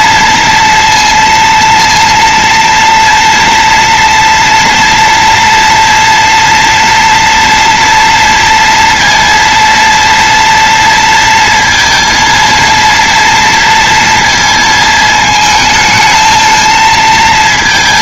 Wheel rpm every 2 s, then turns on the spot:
230, 230, 230, 230, 230, 230, 230, 220, 220.
none